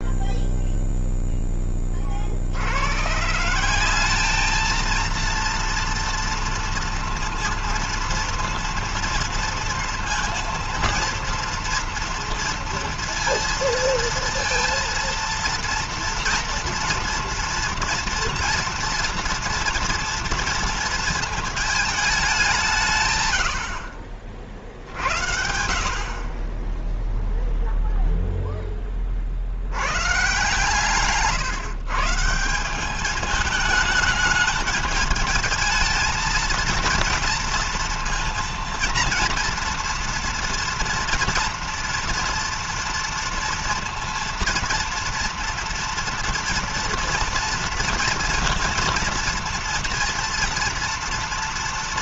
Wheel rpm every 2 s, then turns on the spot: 0, 80, 220, 230, 230, 230, 230, 230, 230, 230, 230, 200, 60, 20, 0, 130, 180, 220, 230, 230, 240, 240, 230, 230, 230, 230.
none